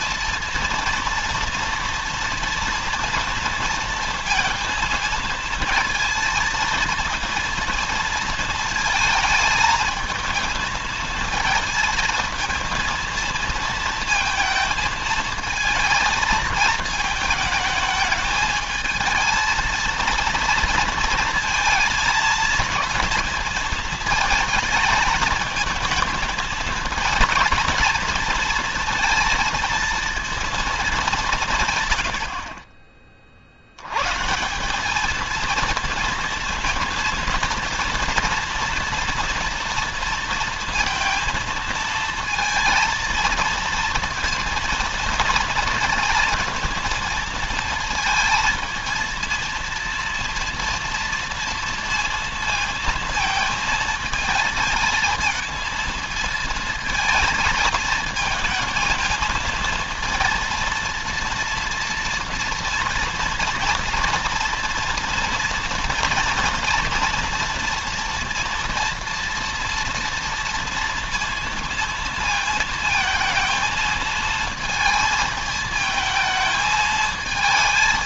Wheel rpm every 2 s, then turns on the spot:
230, 230, 230, 230, 230, 220, 230, 220, 220, 220, 230, 230, 220, 230, 230, 190, 40, 220, 230, 230, 220, 230, 230, 230, 230, 230, 230, 220, 220, 230, 230, 230, 230, 230, 230, 230, 220, 220, 220.
none